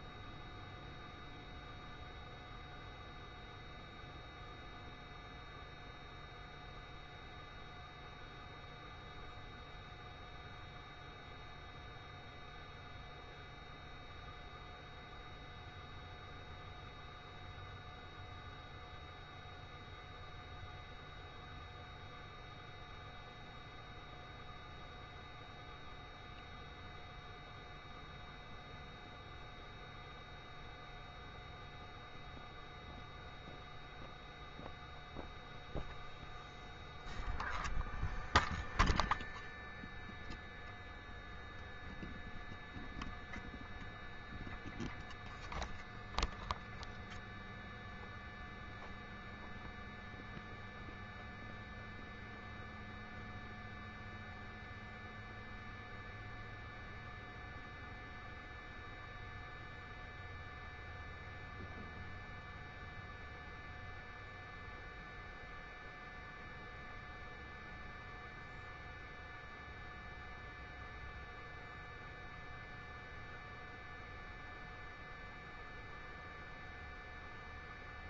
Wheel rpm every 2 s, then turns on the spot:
0, 0, 0, 0, 0, 0, 0, 0, 0, 0, 0, 0, 0, 0, 0, 0, 0, 0, 0, 0, 0, 0, 0, 0, 0, 0, 0, 0, 0, 0, 0, 0, 0, 0, 0, 0, 0, 0, 0.
none